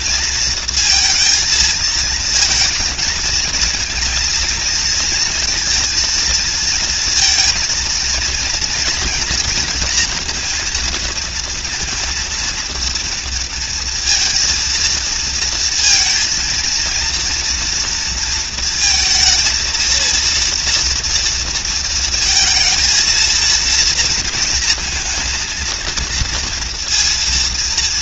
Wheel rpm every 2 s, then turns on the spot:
230, 220, 230, 230, 230, 230, 230, 230, 230, 230, 230, 230, 230, 230.
none